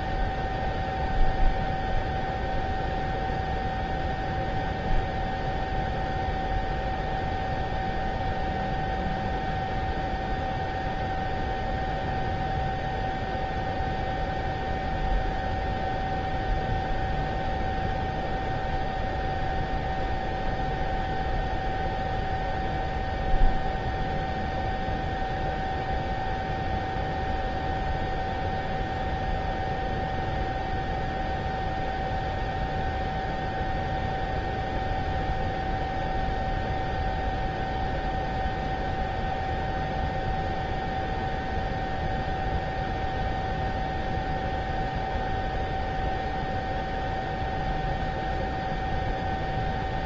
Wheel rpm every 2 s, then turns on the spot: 0, 0, 0, 0, 0, 0, 0, 0, 0, 0, 0, 0, 0, 0, 0, 0, 0, 0, 0, 0, 0, 0, 0, 0, 0.
none